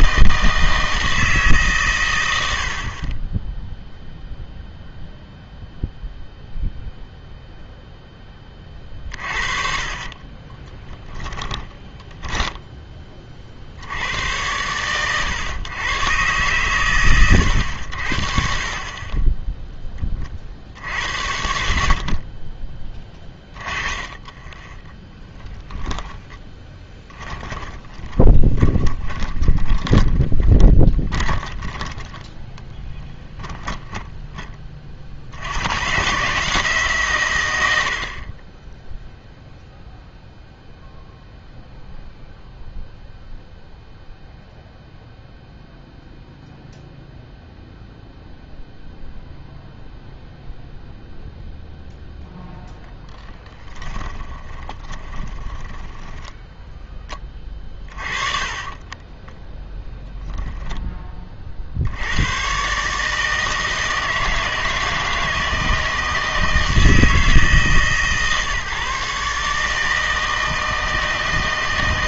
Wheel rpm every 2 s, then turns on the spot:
160, 60, 0, 0, 30, 20, 10, 110, 120, 40, 70, 20, 20, 20, 20, 20, 10, 30, 150, 10, 0, 0, 0, 0, 0, 0, 10, 20, 10, 20, 10, 140, 160, 160, 140, 160.
10-12 24-34 54-56 58-60